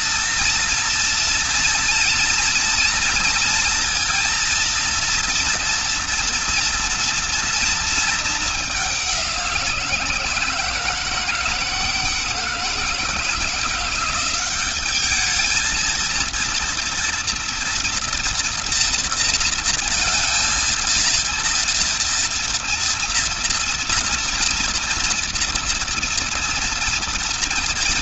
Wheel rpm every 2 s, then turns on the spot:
230, 230, 230, 230, 190, 160, 170, 210, 230, 230, 230, 230, 230, 230.
none